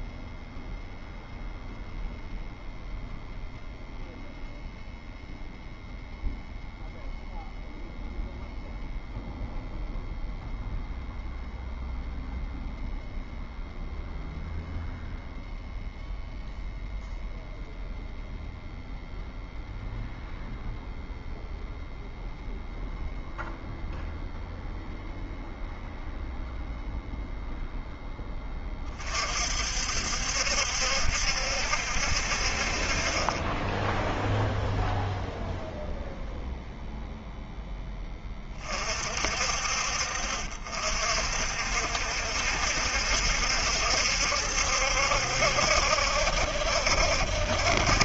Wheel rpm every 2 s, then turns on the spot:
0, 0, 0, 0, 0, 0, 0, 0, 0, 0, 0, 0, 0, 0, 20, 70, 40, 0, 0, 40, 50, 70, 70, 70.
none